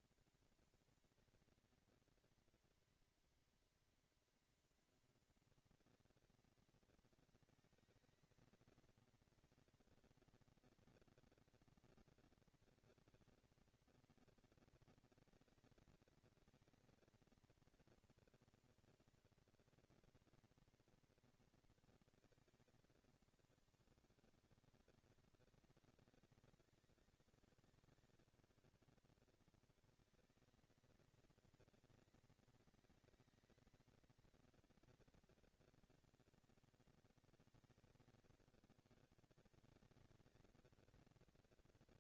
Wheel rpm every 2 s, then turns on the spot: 230, 230, 230, 230, 220, 230, 230, 230, 230, 230, 240, 220, 190, 190, 210, 230, 220, 230, 210, 180, 220.
none